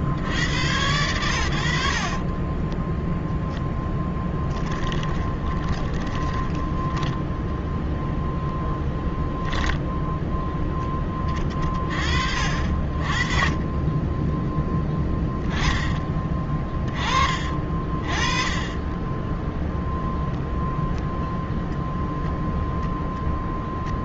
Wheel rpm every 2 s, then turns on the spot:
70, 20, 10, 20, 0, 0, 40, 10, 10, 30, 0, 0.
2-8 14-16